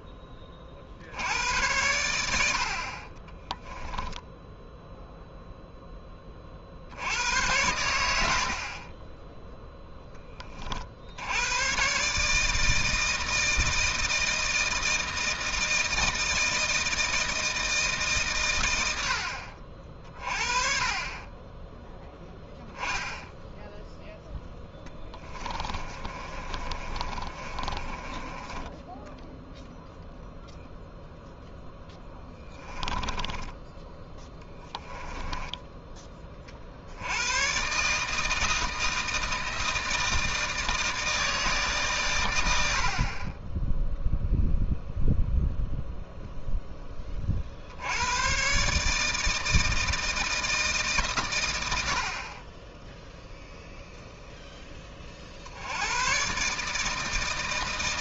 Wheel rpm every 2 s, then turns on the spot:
30, 70, 10, 50, 40, 40, 160, 160, 160, 90, 40, 0, 10, 30, 10, 0, 10, 10, 60, 160, 160, 60, 0, 10, 140, 150, 10, 20, 150.
24-28 32-36